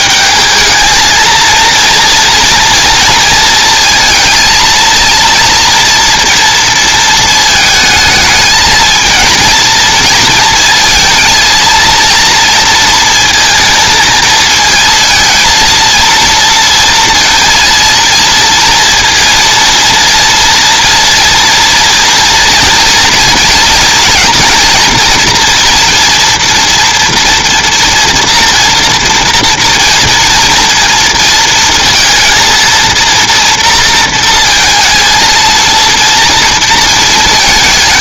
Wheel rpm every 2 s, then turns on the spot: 220, 230, 230, 230, 220, 230, 230, 230, 230, 230, 230, 240, 240, 230, 230, 230, 230, 230, 230.
none